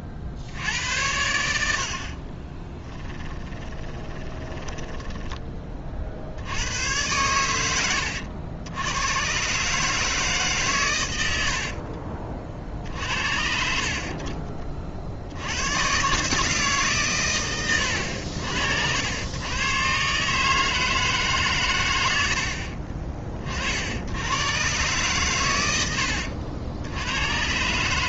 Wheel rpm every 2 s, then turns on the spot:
80, 20, 10, 100, 100, 110, 50, 40, 140, 80, 160, 40, 130, 90.
2-6